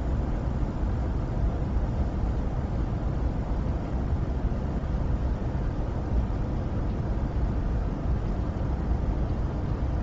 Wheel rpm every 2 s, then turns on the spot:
0, 0, 0, 0, 0.
none